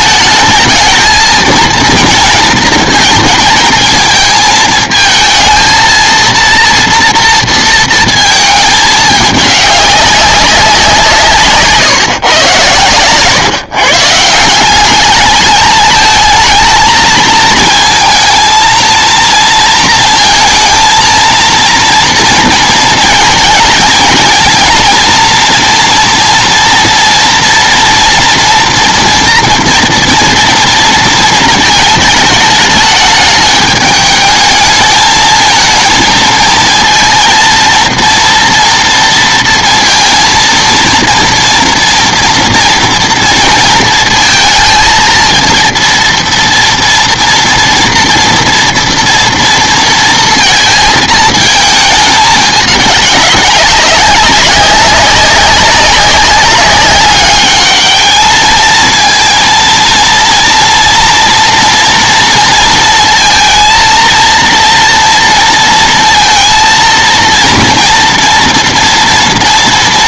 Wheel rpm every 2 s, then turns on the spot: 220, 230, 220, 230, 220, 190, 110, 200, 220, 230, 230, 230, 230, 230, 240, 230, 210, 220, 230, 230, 230, 230, 230, 230, 230, 220, 210, 190, 200, 220, 230, 230, 230, 230, 230.
none